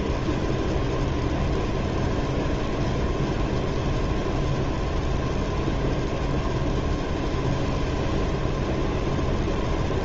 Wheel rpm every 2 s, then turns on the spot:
0, 0, 0, 0, 0.
none